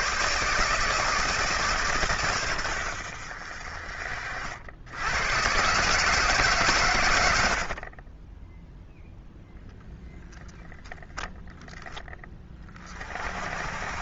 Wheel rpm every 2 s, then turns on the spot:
160, 100, 70, 130, 0, 0, 30.
none